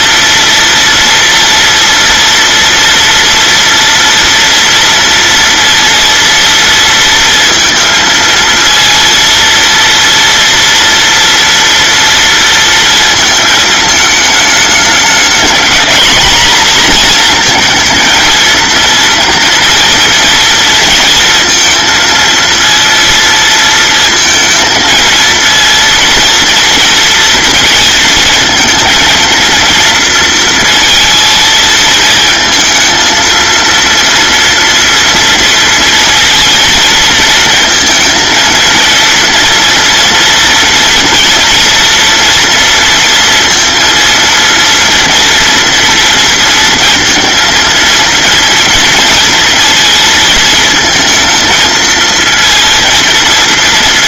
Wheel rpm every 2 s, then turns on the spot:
230, 240, 230, 230, 230, 230, 230, 210, 230, 230, 230, 230, 220, 230, 230, 230, 220, 240, 230, 220, 230, 230, 230, 230, 230, 220, 230.
none